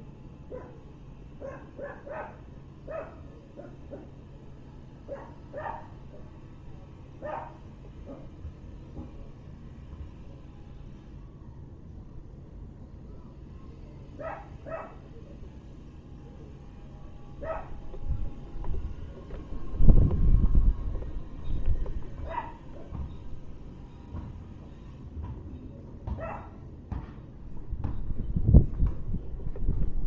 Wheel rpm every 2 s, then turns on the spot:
0, 0, 0, 0, 0, 0, 0, 0, 0, 0, 0, 0, 0, 0, 0.
none